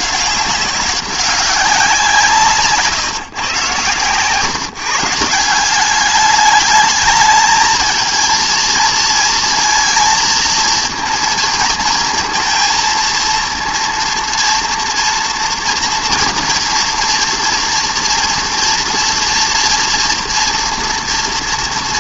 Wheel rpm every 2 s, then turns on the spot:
190, 140, 150, 210, 230, 230, 230, 230, 230, 230, 230.
none